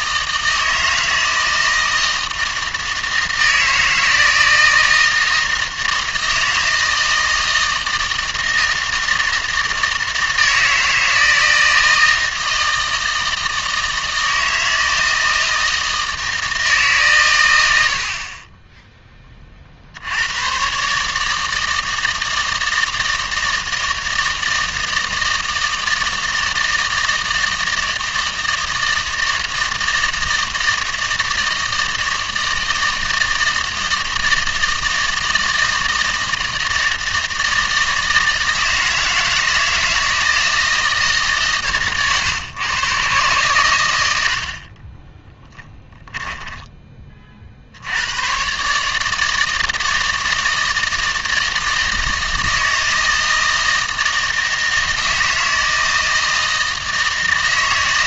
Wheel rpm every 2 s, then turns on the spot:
160, 160, 160, 160, 160, 160, 160, 160, 150, 20, 120, 160, 160, 160, 160, 160, 160, 160, 160, 160, 160, 120, 50, 10, 140, 160, 160, 160, 160.
44-46